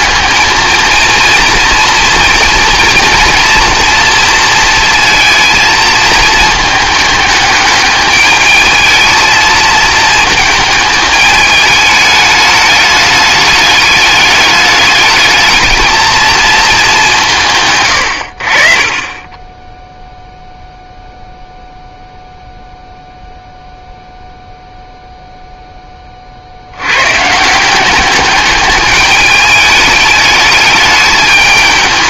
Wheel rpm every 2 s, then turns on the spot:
220, 230, 230, 220, 220, 220, 210, 210, 210, 40, 0, 0, 0, 90, 210, 210.
none